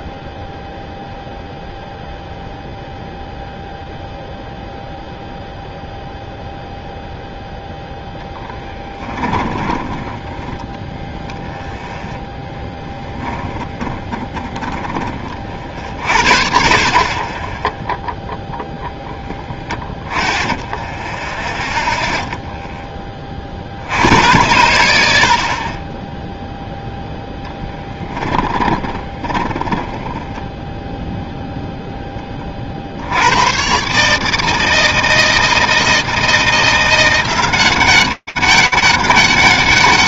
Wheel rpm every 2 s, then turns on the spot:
0, 0, 0, 0, 10, 0, 10, 40, 0, 10, 0, 70, 20, 10, 10, 0, 130, 160, 190, 190.
8-10 12-14 18-20 26-30